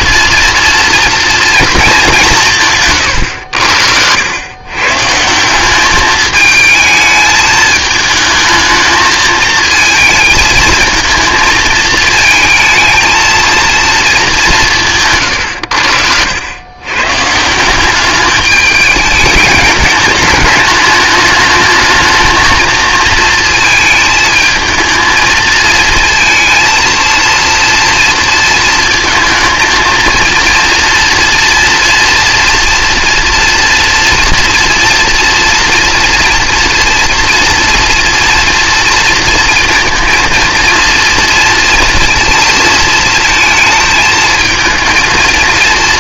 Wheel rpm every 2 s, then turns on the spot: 230, 140, 130, 220, 220, 220, 220, 170, 110, 210, 210, 220, 220, 230, 230, 230, 230, 230, 230, 230, 230, 230, 220.
none